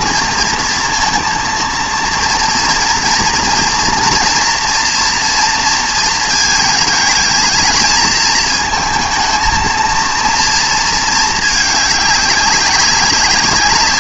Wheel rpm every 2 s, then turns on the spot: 230, 230, 240, 220, 220, 230, 200.
none